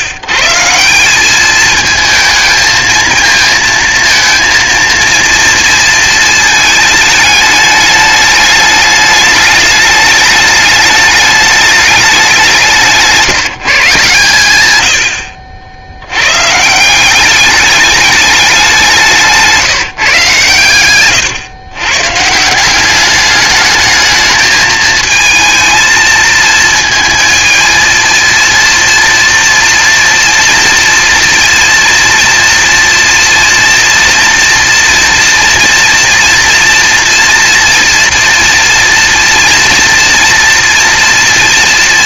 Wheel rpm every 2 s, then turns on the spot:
160, 220, 230, 220, 210, 210, 170, 110, 160, 160, 120, 190, 220, 220, 230, 230, 230, 230, 230, 230, 240.
none